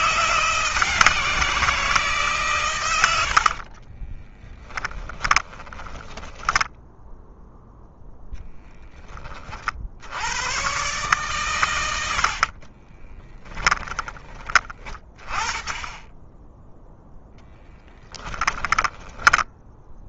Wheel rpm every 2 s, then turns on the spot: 170, 100, 10, 0, 10, 120, 20, 30, 10, 10.
2-6 12-14 18-20